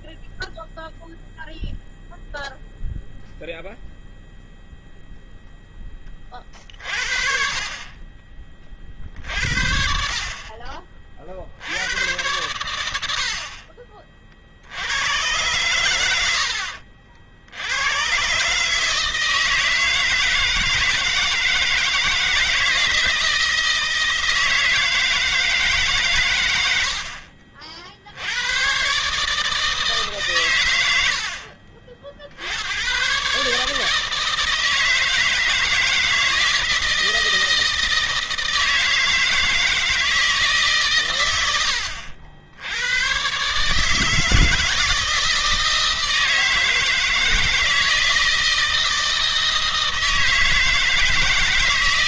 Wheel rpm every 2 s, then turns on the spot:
0, 0, 0, 40, 40, 40, 80, 90, 60, 150, 160, 160, 160, 80, 120, 80, 110, 160, 160, 160, 130, 100, 160, 160, 160, 160.
30-32